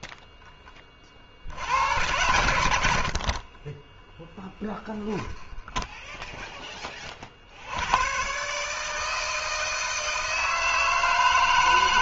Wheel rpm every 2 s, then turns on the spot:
10, 90, 20, 30, 150, 160.
4-6